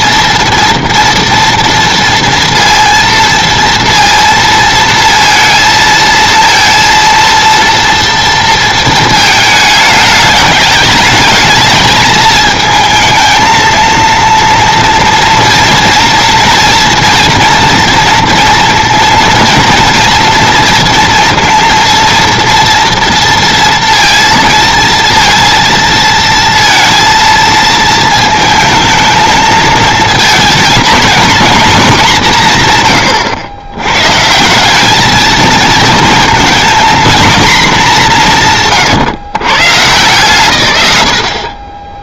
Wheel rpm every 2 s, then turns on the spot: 240, 230, 230, 230, 230, 210, 220, 230, 240, 230, 230, 230, 230, 230, 220, 230, 160, 180, 230, 170, 120.
38-40